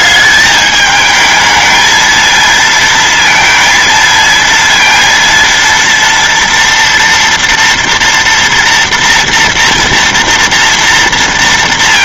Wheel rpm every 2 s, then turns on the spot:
210, 230, 230, 230, 230, 230.
none